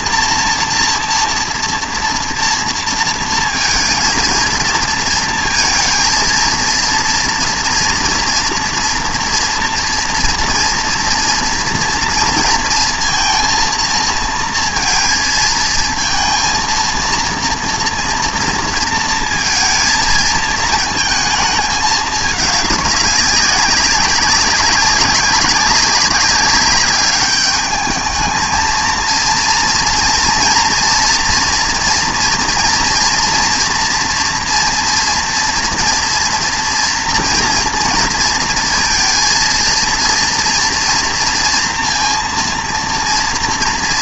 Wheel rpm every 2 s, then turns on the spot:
230, 230, 230, 230, 230, 230, 230, 230, 230, 230, 220, 210, 200, 200, 220, 240, 230, 230, 230, 230, 230, 230.
none